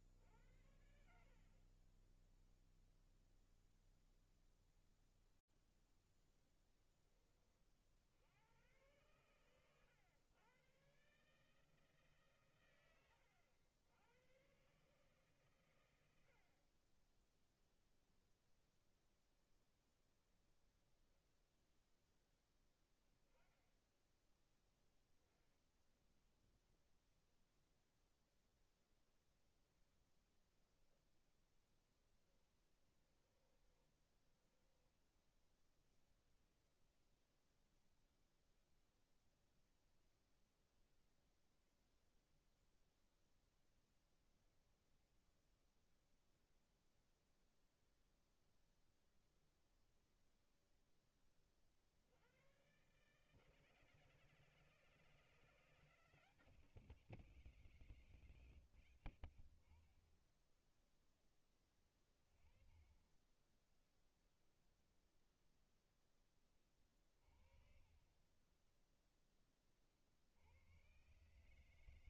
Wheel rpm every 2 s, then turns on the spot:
70, 0, 10, 20, 110, 150, 100, 110, 0, 0, 0, 10, 10, 0, 10, 10, 20, 0, 0, 0, 0, 0, 0, 0, 0, 20, 150, 170, 170, 70, 10, 10, 0, 30, 10, 120.
32-34